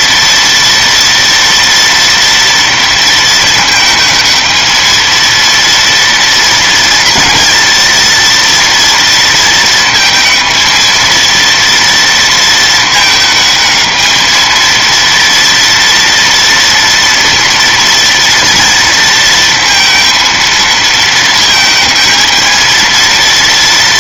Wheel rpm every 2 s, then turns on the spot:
230, 220, 230, 230, 230, 230, 220, 230, 230, 230, 220, 230.
none